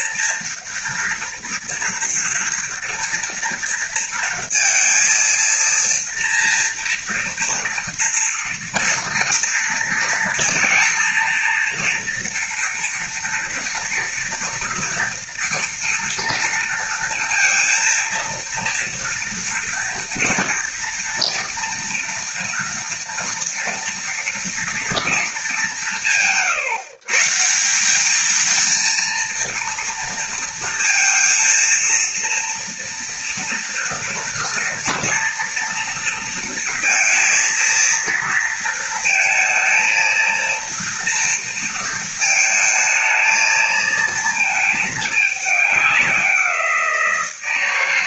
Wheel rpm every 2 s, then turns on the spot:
230, 230, 230, 230, 230, 230, 230, 230, 230, 230, 230, 240, 230, 140, 230, 230, 230, 230, 230, 220, 230, 220, 220, 170.
none